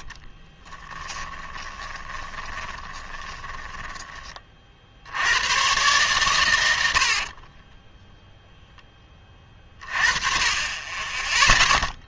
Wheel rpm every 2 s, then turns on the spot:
30, 20, 50, 100, 0, 30.
0-4